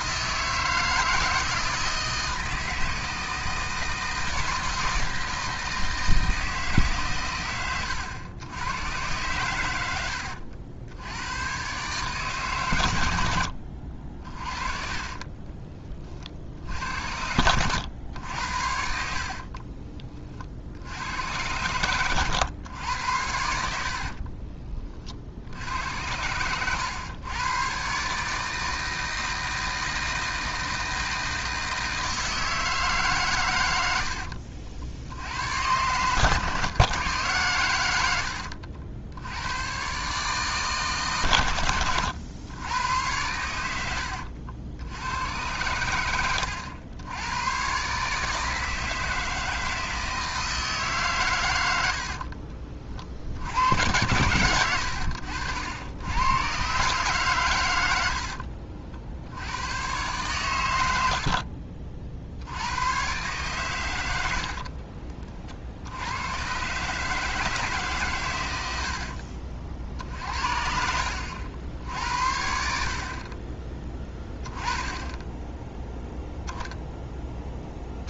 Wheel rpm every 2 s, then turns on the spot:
160, 160, 160, 150, 100, 80, 120, 40, 70, 80, 50, 110, 30, 100, 160, 160, 160, 70, 130, 70, 150, 100, 70, 90, 160, 160, 40, 90, 130, 60, 100, 90, 60, 120, 90, 60, 70, 20, 0.
14-16 24-26 38-40 64-66